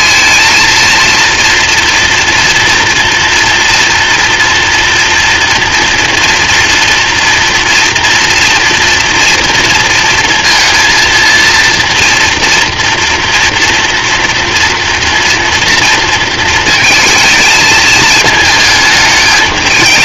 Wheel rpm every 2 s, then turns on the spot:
230, 240, 230, 230, 230, 230, 230, 230, 220, 210.
none